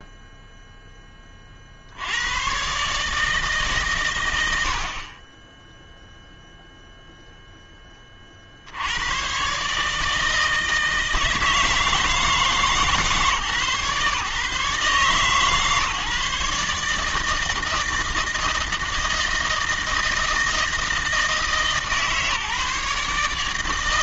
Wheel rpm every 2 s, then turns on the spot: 0, 100, 90, 0, 50, 160, 160, 140, 150, 160, 160, 150.
none